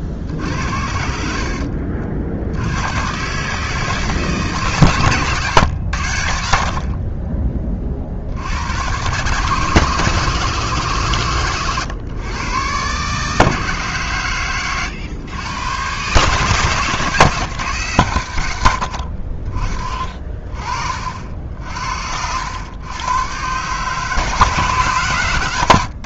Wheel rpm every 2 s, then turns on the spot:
80, 90, 140, 70, 90, 150, 130, 110, 140, 90, 50, 100, 150.
none